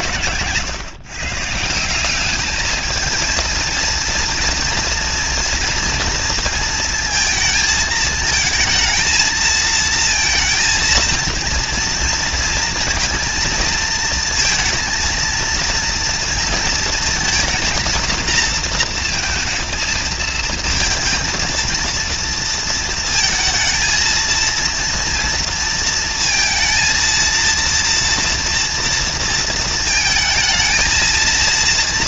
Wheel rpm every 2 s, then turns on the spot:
140, 130, 230, 230, 220, 220, 230, 230, 230, 230, 230, 230, 220, 230, 230, 230.
none